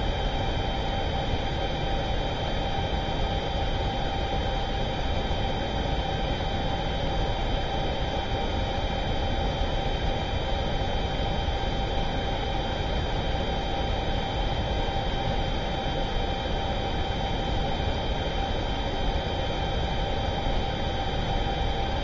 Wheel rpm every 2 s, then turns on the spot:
0, 0, 0, 0, 0, 0, 0, 0, 0, 0, 0.
none